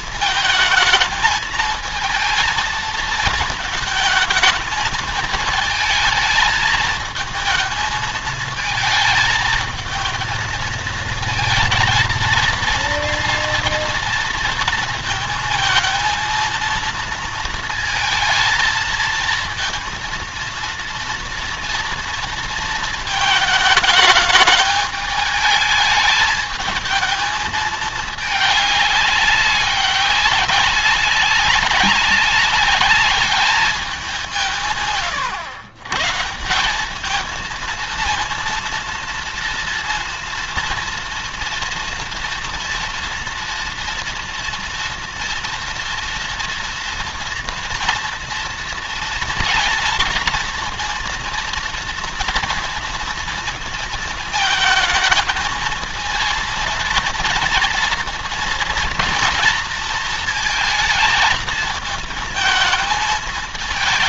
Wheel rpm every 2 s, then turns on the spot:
220, 230, 220, 220, 220, 230, 230, 230, 230, 230, 230, 220, 210, 220, 200, 190, 210, 130, 210, 230, 230, 230, 230, 230, 230, 230, 230, 220, 230, 230, 220, 220.
none